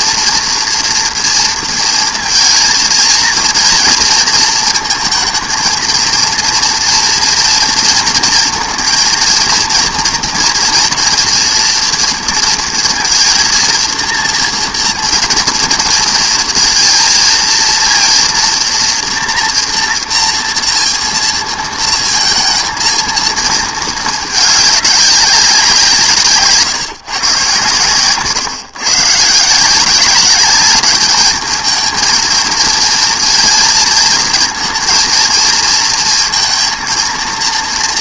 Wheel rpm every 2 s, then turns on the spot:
230, 230, 230, 230, 230, 230, 230, 230, 230, 240, 230, 230, 210, 150, 140, 200, 230, 230, 230.
none